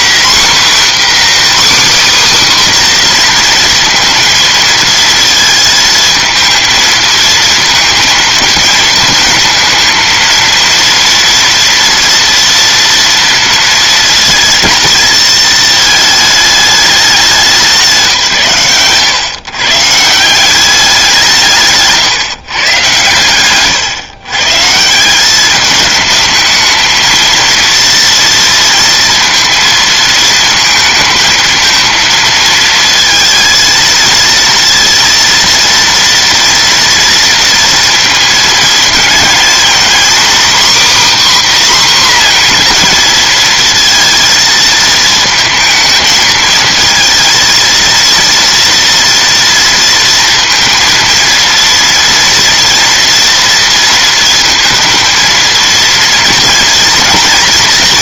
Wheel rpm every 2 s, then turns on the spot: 270, 270, 230, 220, 220, 230, 230, 220, 220, 110, 190, 140, 160, 220, 230, 220, 220, 230, 230, 230, 270, 250, 230, 230, 230, 230, 230, 230, 230.
none